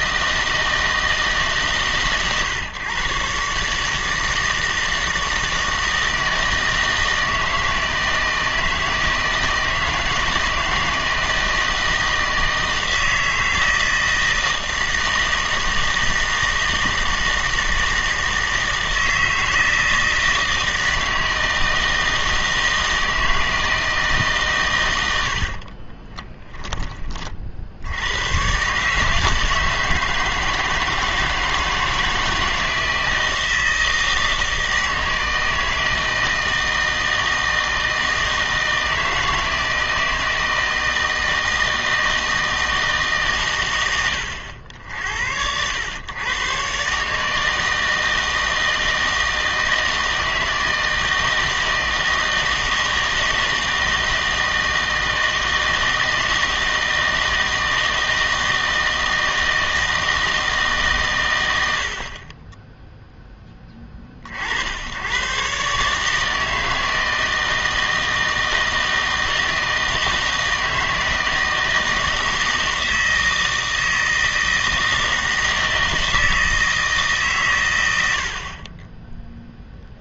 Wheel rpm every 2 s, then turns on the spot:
160, 120, 160, 160, 160, 160, 160, 160, 160, 160, 160, 160, 110, 10, 130, 160, 160, 160, 160, 160, 160, 160, 80, 130, 160, 160, 160, 160, 160, 160, 160, 10, 70, 160, 160, 160, 160, 160, 160, 30.
78-80